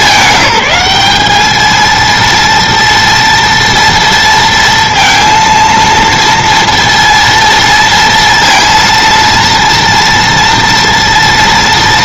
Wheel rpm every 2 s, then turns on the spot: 200, 230, 230, 230, 230, 230.
none